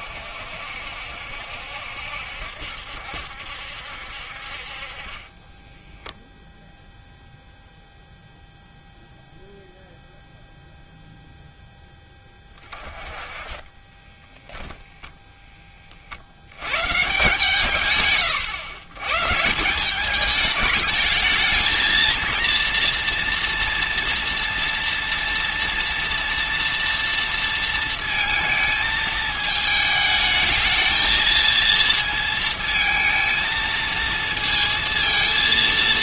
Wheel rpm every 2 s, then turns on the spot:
70, 70, 40, 0, 0, 0, 30, 10, 120, 110, 220, 230, 230, 230, 220, 220, 230, 230.
14-16